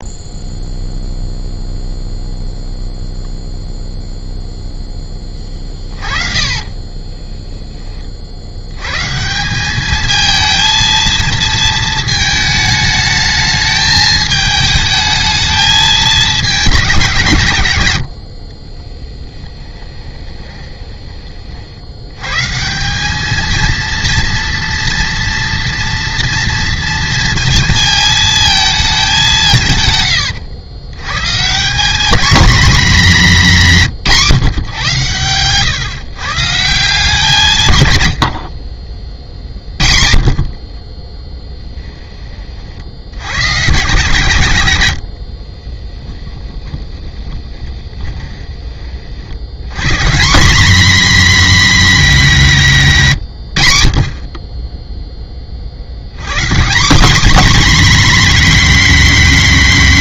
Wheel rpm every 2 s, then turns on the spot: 0, 0, 0, 30, 70, 220, 220, 220, 210, 50, 20, 140, 230, 230, 220, 100, 230, 140, 150, 70, 50, 40, 110, 10, 20, 210, 200, 20, 140, 250.
6-8 18-22 38-42 46-48